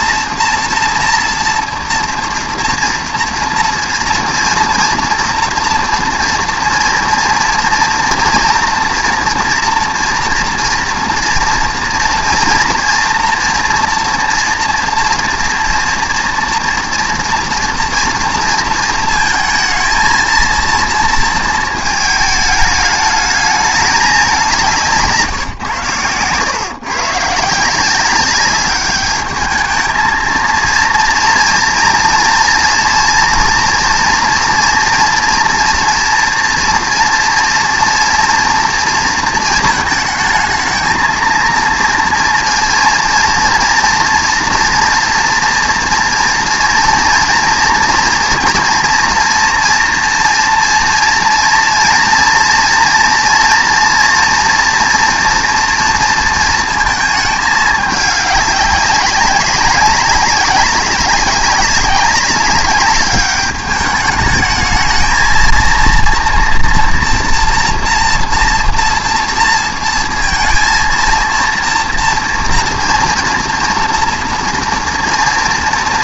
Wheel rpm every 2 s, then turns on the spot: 230, 230, 230, 230, 230, 230, 230, 230, 230, 230, 230, 220, 180, 120, 200, 230, 230, 230, 230, 230, 220, 230, 230, 230, 230, 240, 230, 230, 220, 200, 190, 200, 220, 230, 230, 230, 230, 230.
none